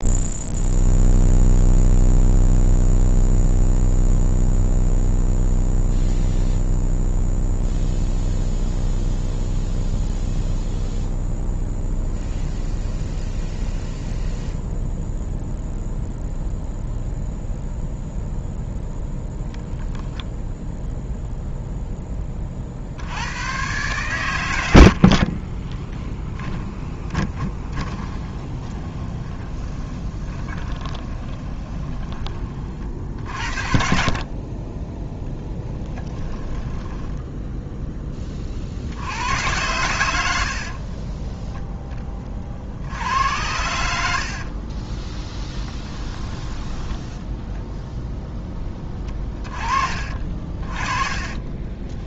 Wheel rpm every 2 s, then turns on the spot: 0, 0, 0, 0, 0, 0, 0, 0, 0, 0, 0, 70, 70, 10, 20, 20, 60, 10, 10, 70, 40, 70, 10, 10, 20, 20.
24-32 36-38 40-42 46-48 50-52